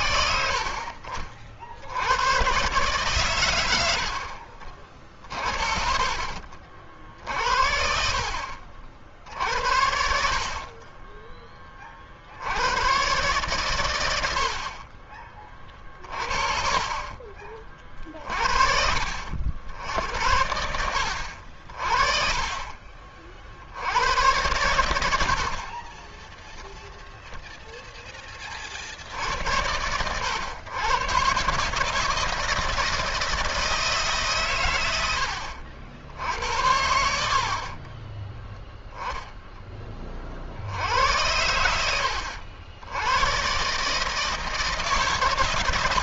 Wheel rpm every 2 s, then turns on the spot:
60, 140, 50, 70, 60, 20, 100, 40, 40, 60, 70, 40, 90, 0, 60, 120, 170, 80, 80, 0, 80, 100, 140.
10-12 14-16 24-26 36-38